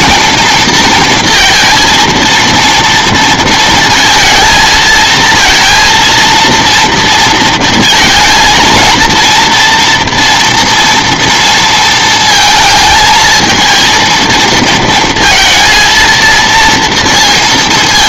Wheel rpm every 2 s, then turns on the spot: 230, 230, 230, 230, 230, 230, 220, 230, 230.
none